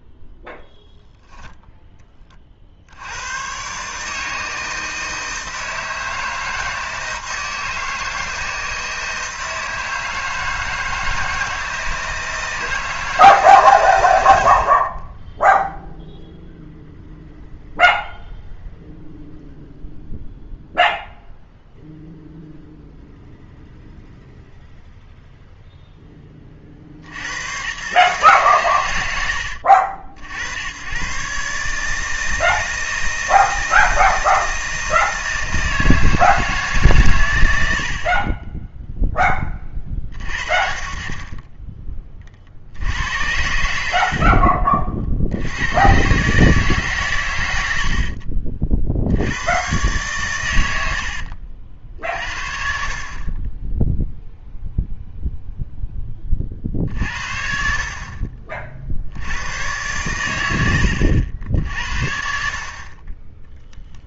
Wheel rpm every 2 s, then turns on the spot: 0, 50, 160, 160, 160, 160, 160, 60, 0, 0, 0, 0, 0, 40, 120, 90, 160, 170, 150, 10, 40, 70, 40, 150, 50, 90, 50, 0, 40, 50, 90, 50.
50-52